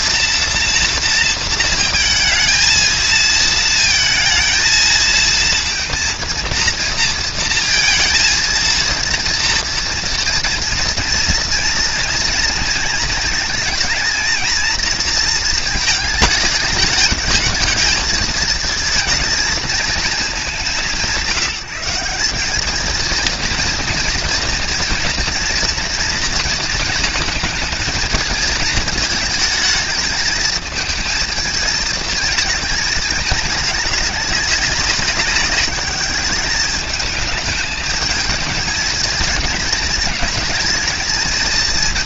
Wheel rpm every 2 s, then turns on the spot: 230, 220, 220, 230, 230, 230, 230, 230, 220, 220, 180, 220, 230, 220, 220, 220, 210, 200, 210, 220, 220.
none